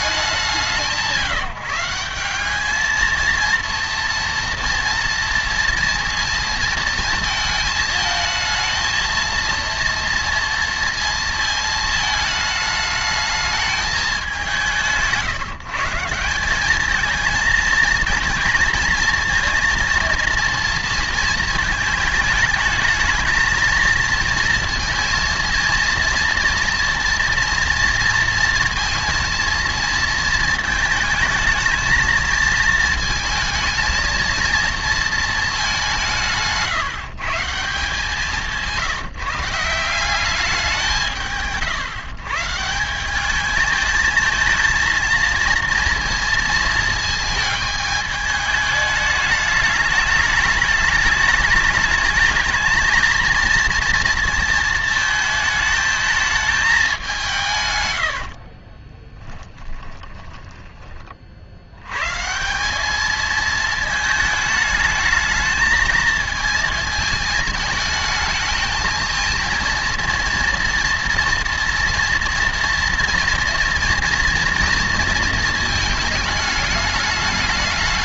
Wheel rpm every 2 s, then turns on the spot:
160, 210, 230, 230, 230, 230, 220, 170, 200, 230, 230, 220, 230, 230, 230, 220, 220, 230, 160, 170, 190, 160, 220, 230, 210, 210, 230, 220, 210, 40, 10, 190, 220, 220, 220, 230, 230, 230, 210.
36-40 58-60